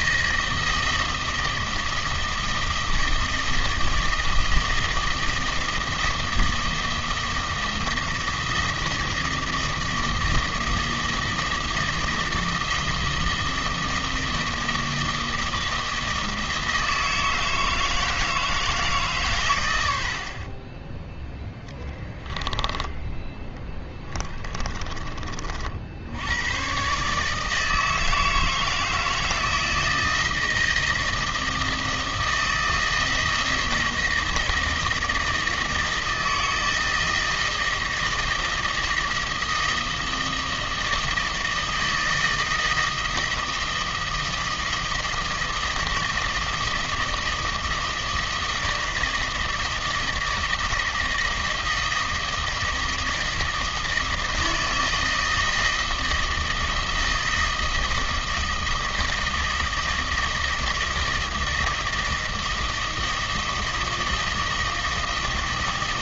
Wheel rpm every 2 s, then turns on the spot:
160, 160, 160, 160, 160, 160, 160, 160, 160, 160, 30, 10, 20, 120, 160, 160, 160, 160, 160, 160, 160, 160, 160, 160, 160, 160, 160, 160, 160, 160, 160, 160, 160.
none